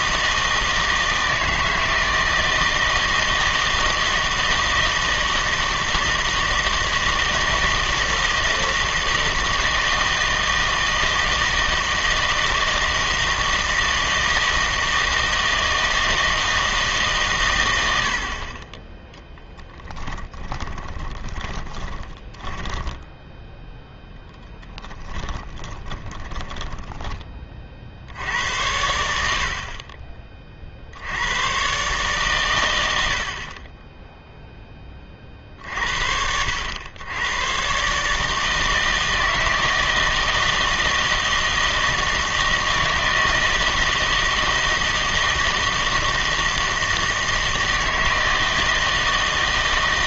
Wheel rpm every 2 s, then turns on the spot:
160, 160, 160, 160, 160, 160, 160, 160, 160, 20, 20, 10, 10, 10, 90, 50, 110, 10, 90, 160, 160, 160, 160, 160, 160.
20-24 26-28